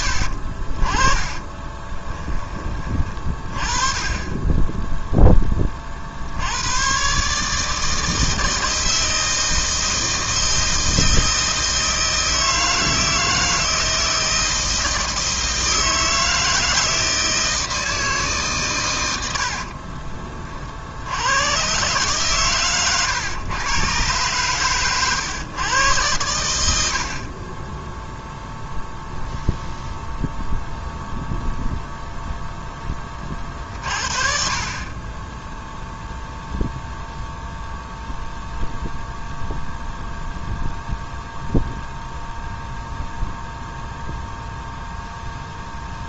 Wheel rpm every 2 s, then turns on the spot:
30, 30, 10, 110, 160, 160, 160, 160, 160, 110, 80, 120, 110, 70, 0, 0, 10, 20, 0, 0, 0, 0, 0.
0-2